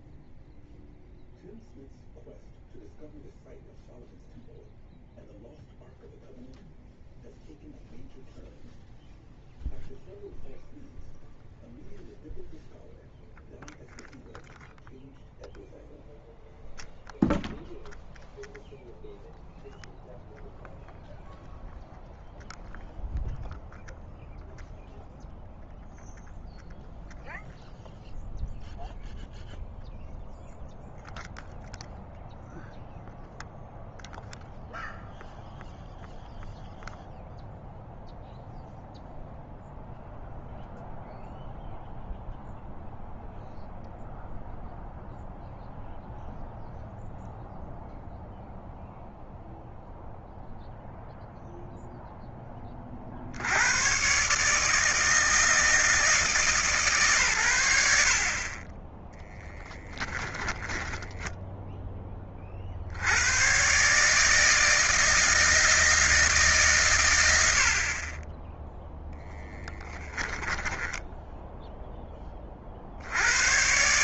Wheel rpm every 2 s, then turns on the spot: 0, 0, 0, 0, 0, 0, 0, 0, 0, 0, 0, 0, 0, 0, 0, 0, 0, 0, 0, 0, 0, 0, 0, 0, 0, 0, 20, 150, 150, 30, 10, 40, 160, 150, 20, 10, 50.
60-62 70-72